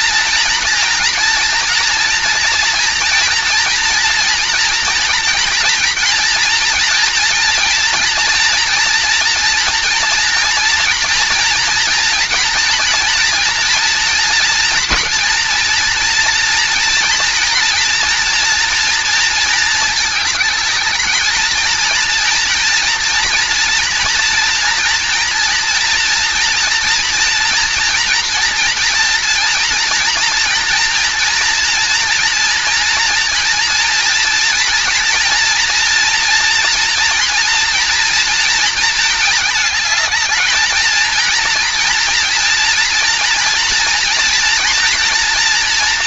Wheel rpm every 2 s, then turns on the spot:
230, 230, 230, 230, 230, 230, 230, 240, 230, 230, 220, 240, 240, 240, 230, 240, 230, 230, 230, 220, 230, 230, 230.
none